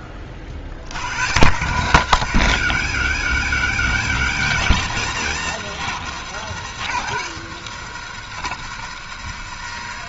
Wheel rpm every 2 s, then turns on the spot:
20, 130, 130, 160, 210.
none